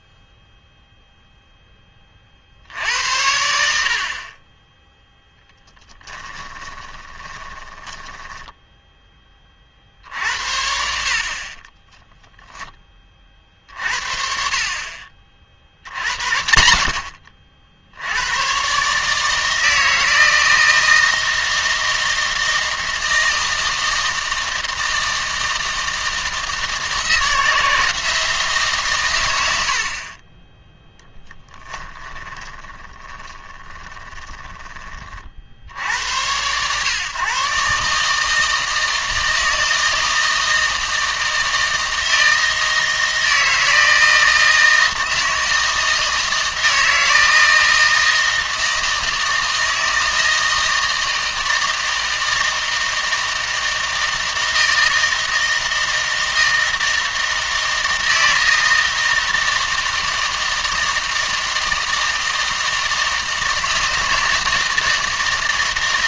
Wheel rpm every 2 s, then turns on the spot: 0, 60, 20, 20, 10, 70, 10, 40, 80, 120, 160, 160, 160, 160, 150, 10, 20, 20, 120, 160, 160, 160, 160, 160, 160, 160, 160, 160, 160, 160, 160, 160, 160.
6-10 32-34